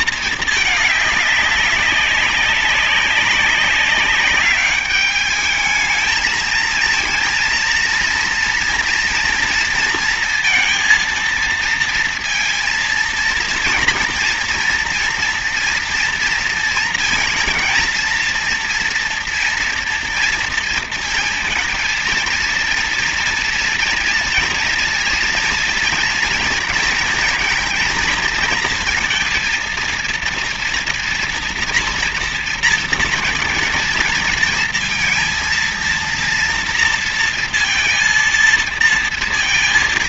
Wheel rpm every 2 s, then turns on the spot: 220, 190, 200, 220, 230, 230, 230, 230, 230, 230, 230, 230, 230, 230, 230, 230, 230, 230, 230, 230.
none